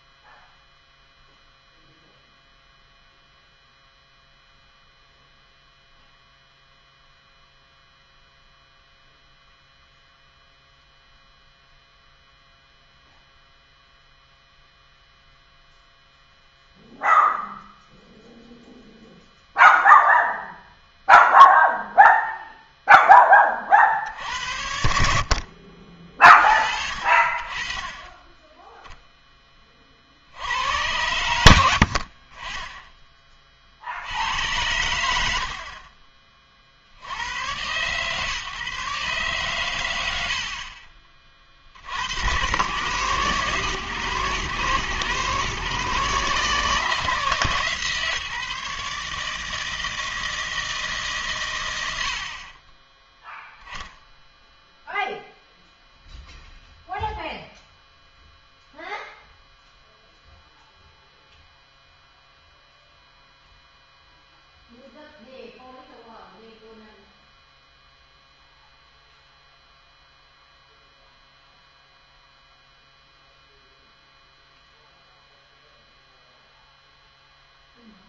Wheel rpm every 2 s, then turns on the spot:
0, 0, 0, 0, 0, 0, 0, 0, 0, 0, 0, 0, 60, 60, 0, 100, 20, 90, 60, 140, 40, 120, 120, 160, 150, 150, 10, 0, 0, 0, 0, 0, 0, 0, 0, 0, 0, 0, 0.
40-42